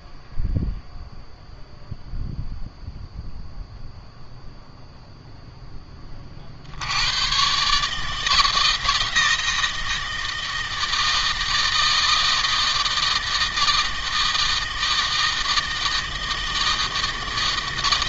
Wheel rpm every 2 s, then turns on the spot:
0, 0, 0, 60, 160, 160, 160, 160, 160.
none